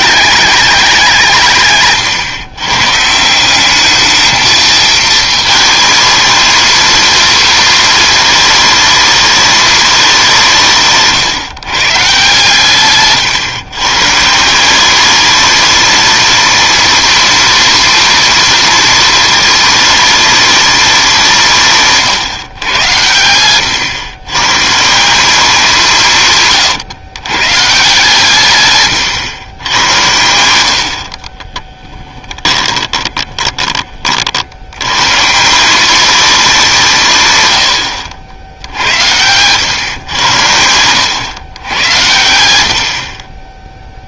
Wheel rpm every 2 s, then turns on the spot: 200, 130, 220, 230, 220, 160, 140, 170, 220, 230, 210, 110, 140, 130, 130, 80, 10, 90, 180, 80, 90, 80.
28-34